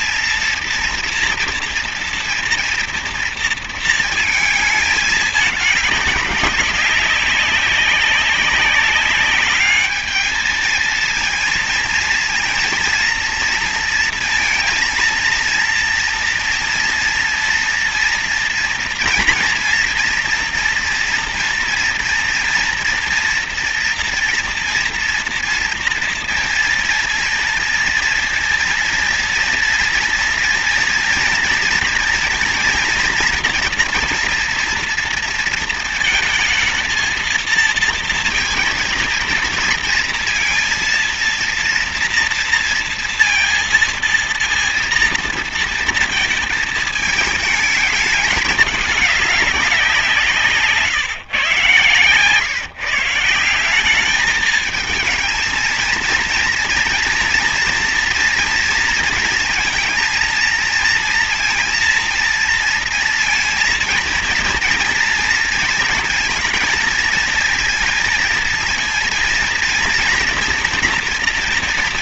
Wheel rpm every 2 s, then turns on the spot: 230, 230, 220, 200, 200, 220, 230, 230, 240, 240, 230, 230, 230, 230, 230, 240, 230, 230, 220, 230, 230, 230, 230, 220, 210, 150, 150, 230, 230, 230, 230, 230, 230, 230, 230, 230.
none